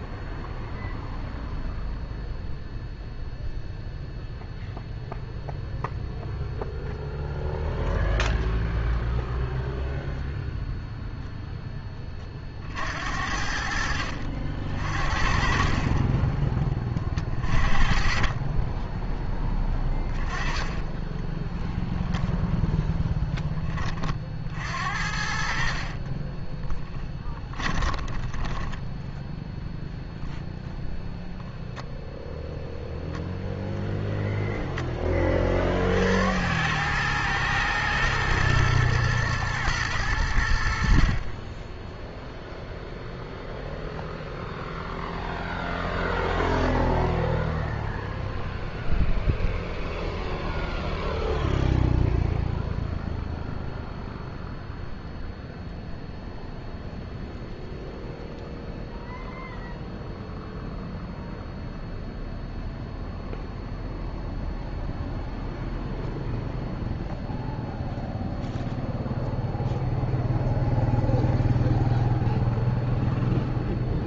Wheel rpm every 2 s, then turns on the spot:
0, 0, 0, 0, 0, 0, 50, 50, 20, 10, 10, 10, 60, 10, 10, 0, 0, 20, 100, 120, 70, 0, 0, 0, 0, 0, 0, 0, 0, 0, 0, 0, 0, 0, 0, 0, 0.
18-22 26-28